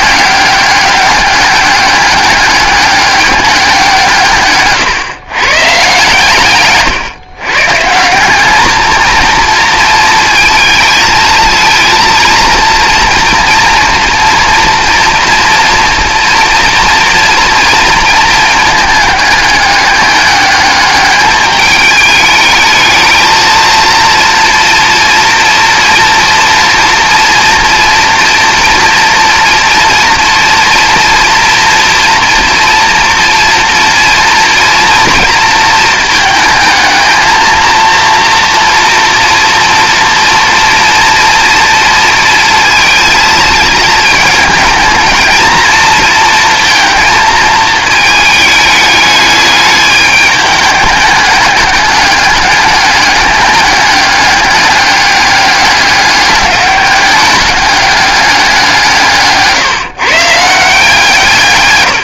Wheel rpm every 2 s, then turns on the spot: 200, 200, 140, 140, 220, 220, 230, 240, 230, 220, 210, 220, 240, 230, 230, 230, 240, 230, 220, 230, 230, 230, 220, 230, 210, 210, 210, 200, 200, 180, 160.
none